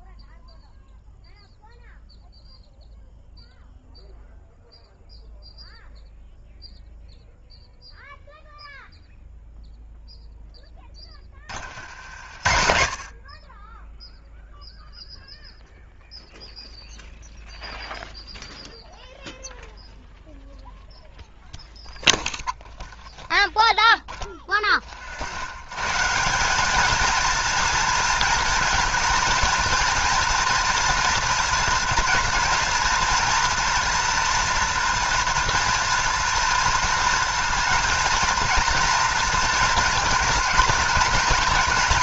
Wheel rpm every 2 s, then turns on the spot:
0, 0, 0, 0, 0, 10, 70, 0, 0, 0, 0, 0, 10, 210, 230, 230, 230, 230, 230, 230, 230.
none